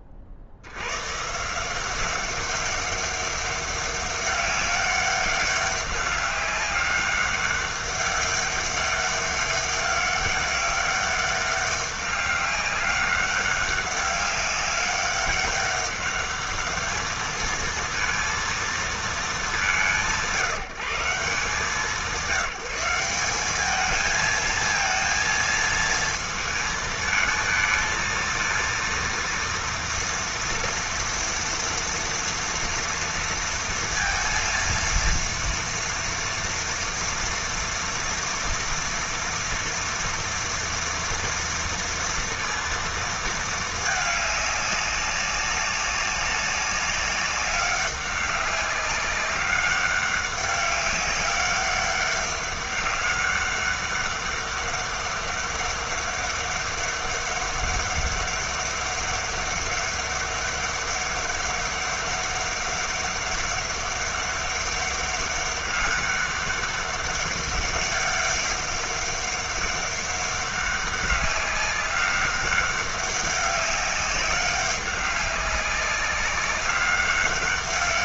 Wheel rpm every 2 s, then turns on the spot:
70, 200, 200, 200, 200, 200, 200, 200, 210, 230, 160, 180, 220, 220, 230, 230, 230, 230, 230, 230, 230, 230, 200, 200, 200, 200, 200, 200, 200, 200, 200, 200, 200, 200, 200, 200, 200, 200, 200.
none